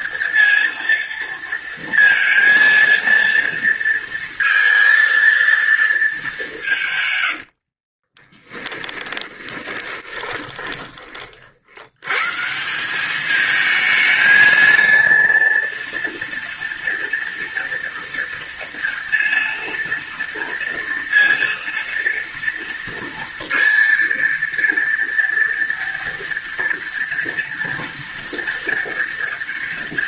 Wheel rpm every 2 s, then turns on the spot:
230, 230, 230, 130, 20, 30, 200, 230, 230, 230, 230, 230, 230, 230, 230.
8-10